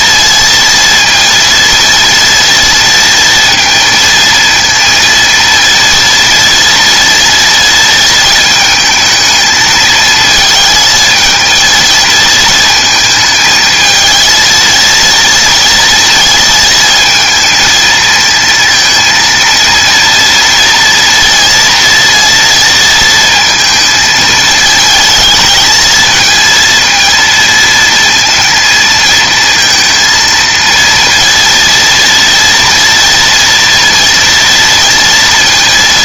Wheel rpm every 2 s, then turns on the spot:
230, 230, 230, 230, 220, 220, 220, 230, 220, 230, 240, 230, 220, 230, 230, 230, 230, 230.
none